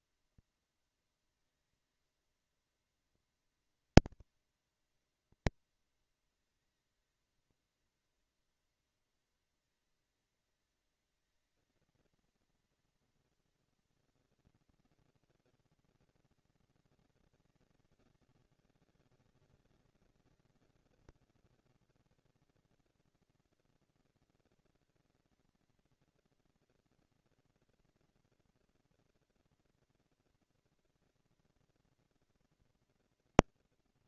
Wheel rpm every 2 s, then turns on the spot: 230, 230, 230, 230, 230, 230, 230, 230, 230, 200, 200, 220, 230, 230, 230, 230, 230.
none